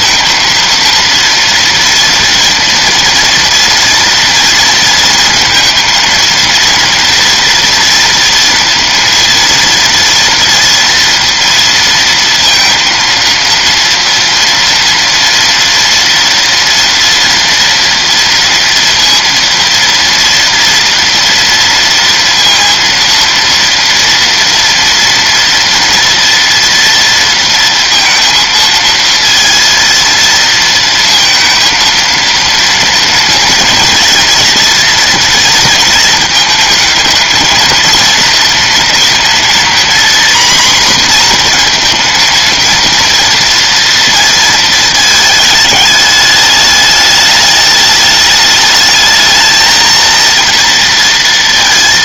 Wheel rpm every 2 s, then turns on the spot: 230, 230, 230, 230, 230, 230, 230, 230, 240, 230, 230, 230, 230, 240, 230, 230, 230, 230, 220, 230, 240, 230, 220, 210, 210, 230.
none